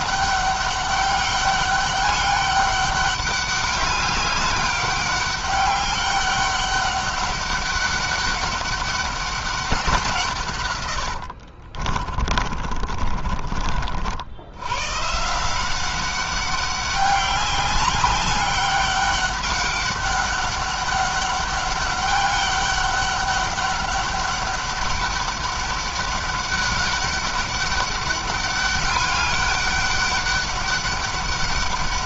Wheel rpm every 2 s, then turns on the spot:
200, 200, 200, 200, 200, 120, 40, 110, 200, 200, 200, 200, 200, 190, 200, 200.
10-14